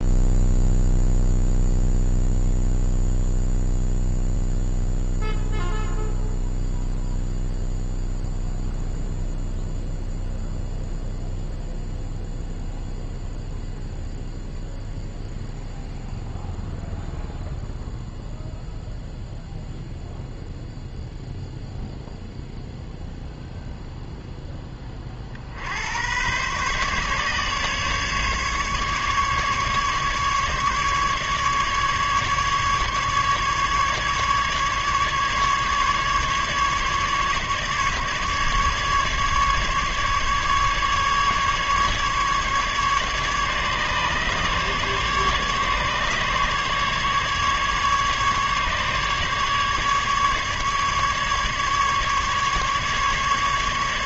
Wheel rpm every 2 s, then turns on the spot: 0, 0, 0, 0, 0, 0, 0, 0, 0, 0, 0, 0, 10, 130, 140, 150, 150, 140, 150, 150, 140, 140, 140, 150, 150, 150, 140.
none